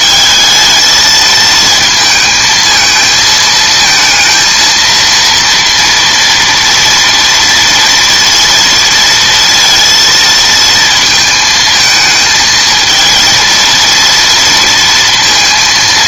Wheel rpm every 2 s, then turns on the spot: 220, 220, 230, 230, 230, 220, 230, 230.
none